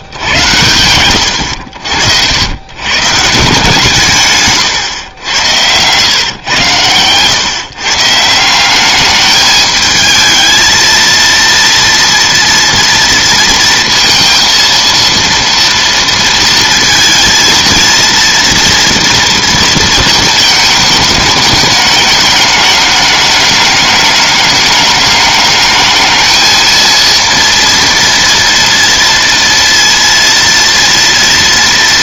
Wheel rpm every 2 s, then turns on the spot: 100, 130, 110, 120, 200, 230, 230, 230, 230, 230, 210, 210, 210, 230, 230, 230.
none